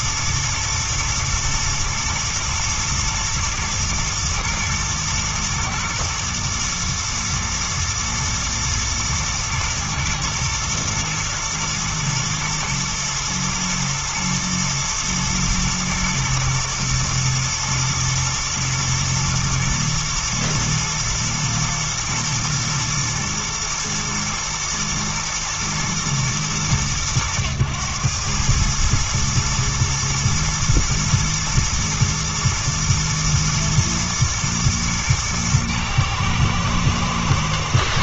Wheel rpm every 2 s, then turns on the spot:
120, 120, 110, 120, 110, 120, 110, 120, 120, 120, 110, 110, 110, 110, 110, 120, 120, 120, 110.
none